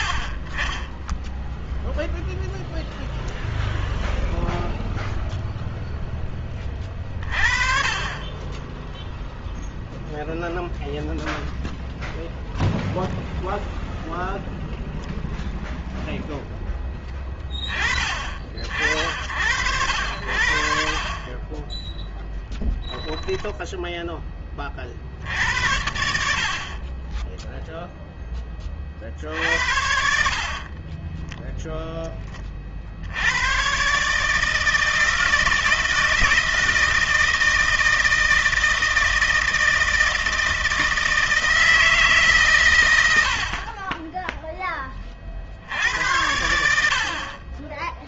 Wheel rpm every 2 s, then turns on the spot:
30, 0, 0, 10, 20, 0, 0, 0, 0, 40, 60, 10, 10, 70, 10, 60, 20, 150, 160, 160, 160, 140, 10, 80.
22-24 44-46